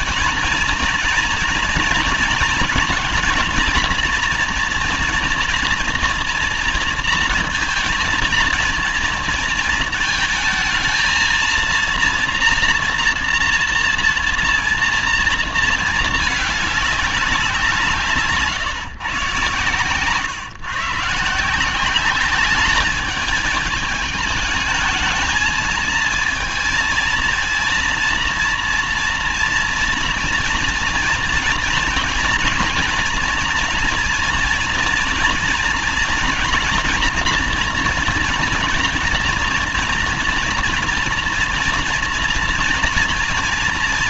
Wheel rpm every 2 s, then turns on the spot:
230, 230, 230, 230, 230, 220, 230, 230, 210, 140, 150, 200, 220, 230, 230, 230, 230, 230, 240, 240, 230, 230.
none